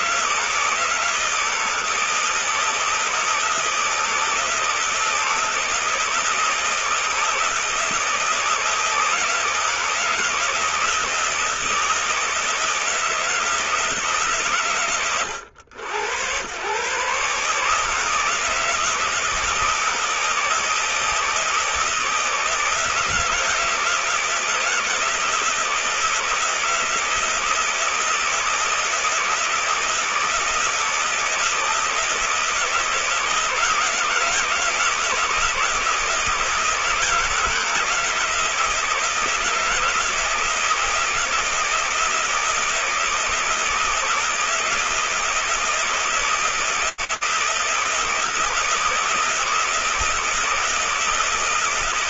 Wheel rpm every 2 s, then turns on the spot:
160, 160, 160, 160, 170, 160, 160, 130, 120, 160, 160, 160, 160, 160, 160, 160, 170, 170, 160, 160, 160, 160, 160, 160, 160, 160.
none